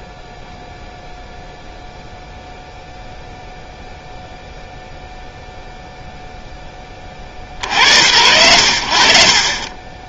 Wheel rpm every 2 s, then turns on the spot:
0, 0, 0, 10, 60.
none